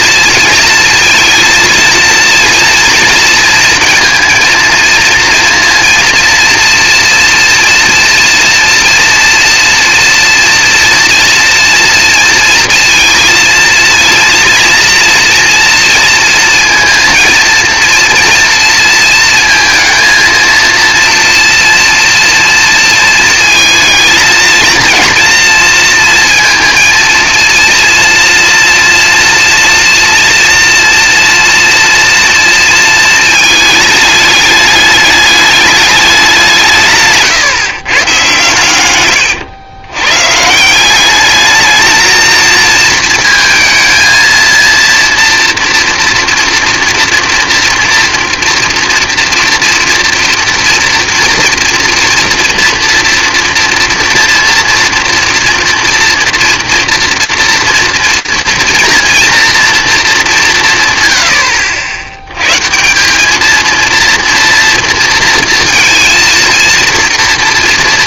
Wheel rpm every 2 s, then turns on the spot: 230, 230, 230, 240, 230, 230, 230, 230, 230, 230, 230, 230, 230, 230, 230, 230, 230, 210, 180, 120, 150, 230, 230, 230, 230, 230, 230, 230, 240, 230, 150, 140, 230, 230.
none